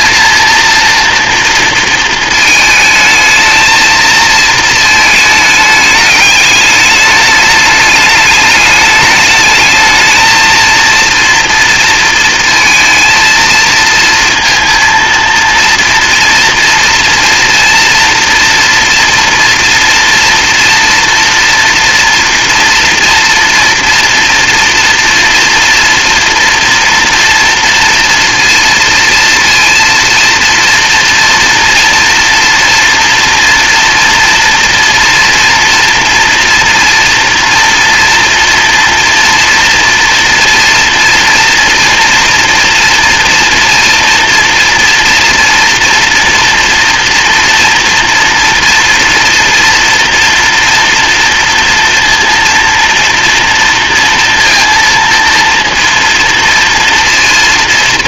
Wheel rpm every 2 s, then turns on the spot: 230, 220, 230, 210, 210, 230, 230, 230, 240, 240, 230, 240, 230, 230, 230, 230, 240, 240, 230, 230, 230, 230, 240, 230, 240, 230, 230, 230, 230.
none